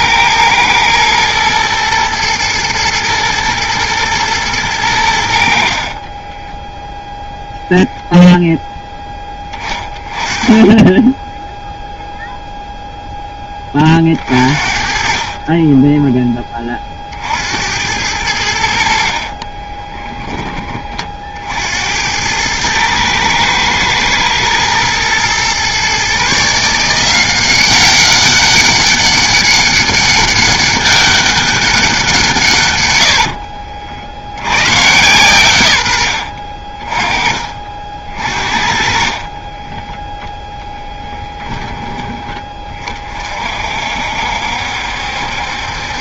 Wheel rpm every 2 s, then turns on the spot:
110, 110, 110, 10, 0, 20, 0, 40, 20, 70, 20, 110, 110, 160, 200, 200, 120, 120, 40, 40, 10, 30, 70.
6-8 36-38 40-42